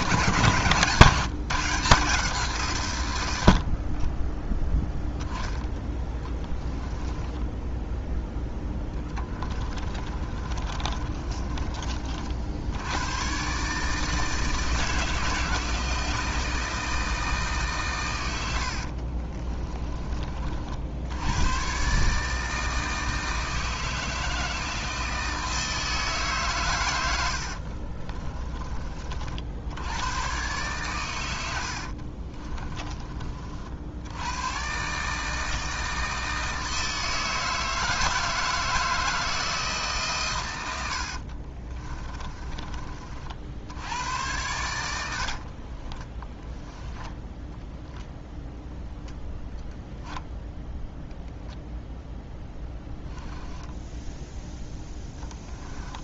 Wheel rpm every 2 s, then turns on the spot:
140, 140, 10, 10, 10, 30, 80, 160, 160, 60, 70, 160, 160, 110, 40, 120, 30, 130, 160, 160, 80, 30, 90, 10, 0, 0, 10, 0.
6-12 18-20 32-34 40-42 46-48 52-54